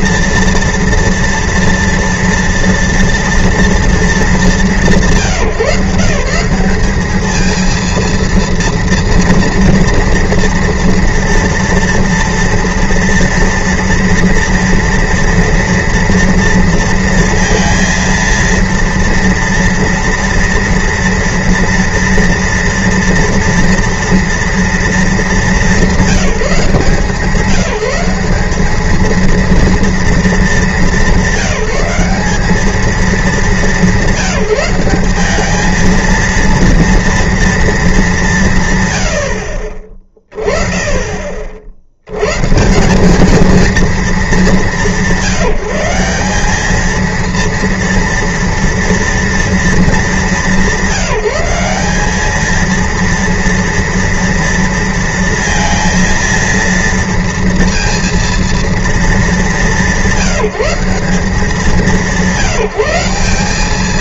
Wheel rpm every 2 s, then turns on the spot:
230, 240, 200, 190, 230, 230, 230, 230, 230, 230, 240, 230, 220, 170, 200, 200, 210, 200, 230, 140, 20, 170, 190, 210, 230, 180, 220, 230, 230, 220, 160, 170.
none